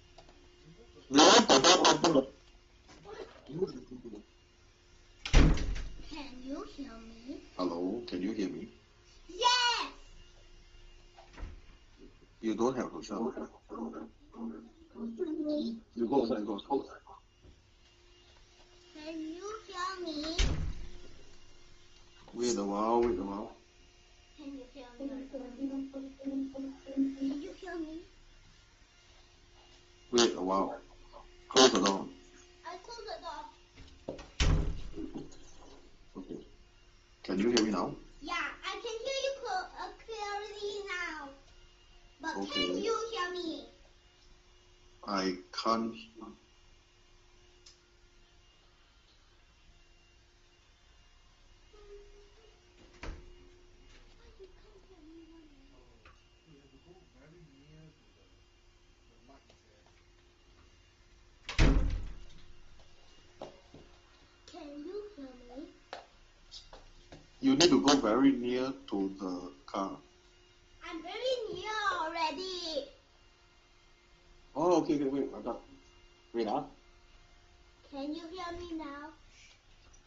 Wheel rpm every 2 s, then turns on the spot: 0, 0, 0, 0, 0, 0, 0, 0, 0, 0, 0, 0, 0, 0, 0, 0, 0, 0, 0, 0, 0, 0, 0, 0, 0, 0, 0, 0, 0, 0, 0, 0, 0, 0, 0, 0, 0, 0, 0, 0.
none